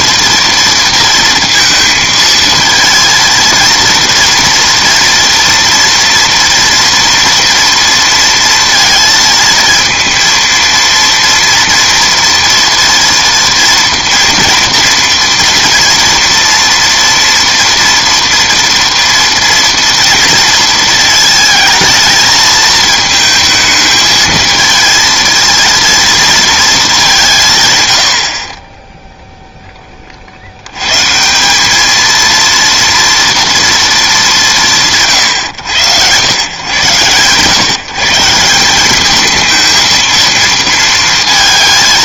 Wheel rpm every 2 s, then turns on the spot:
230, 230, 230, 230, 230, 230, 240, 230, 230, 230, 230, 220, 220, 220, 30, 90, 230, 180, 120, 180, 230.
none